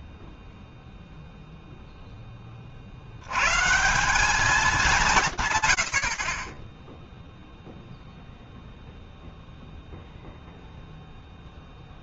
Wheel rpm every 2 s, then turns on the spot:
0, 80, 170, 0, 0, 0.
none